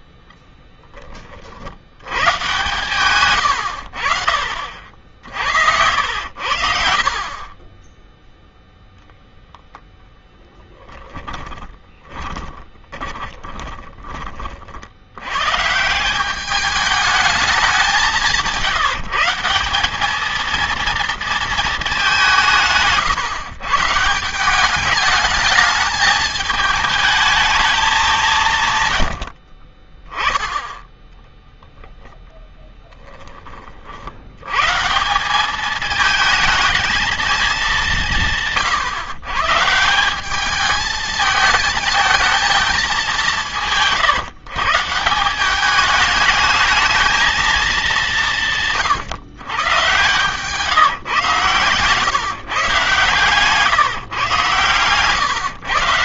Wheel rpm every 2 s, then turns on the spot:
10, 120, 50, 70, 0, 10, 20, 60, 210, 170, 230, 160, 200, 220, 140, 0, 10, 130, 230, 140, 210, 210, 160, 220, 150, 150, 140, 130.
10-14